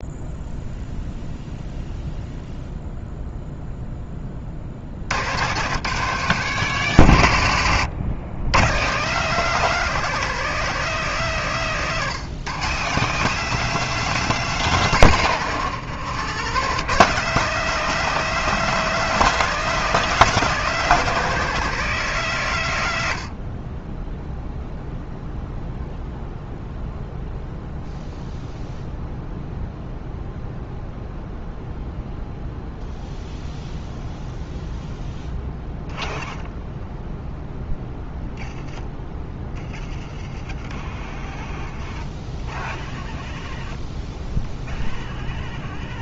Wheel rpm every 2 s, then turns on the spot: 0, 0, 100, 120, 180, 170, 170, 120, 150, 200, 190, 90, 0, 0, 0, 0, 0, 0, 0, 0, 0, 0, 0.
none